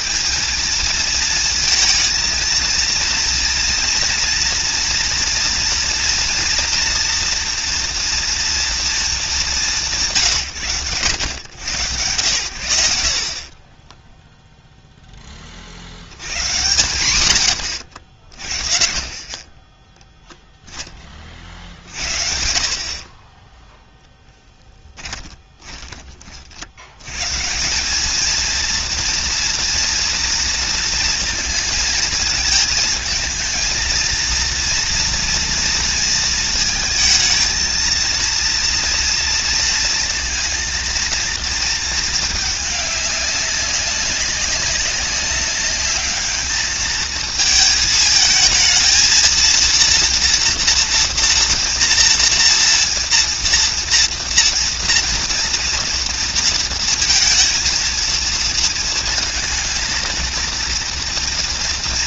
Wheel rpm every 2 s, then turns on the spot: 220, 230, 230, 230, 220, 90, 80, 0, 110, 40, 20, 40, 20, 80, 230, 230, 220, 230, 230, 230, 230, 200, 200, 220, 220, 240, 230, 230, 230, 230, 230.
24-26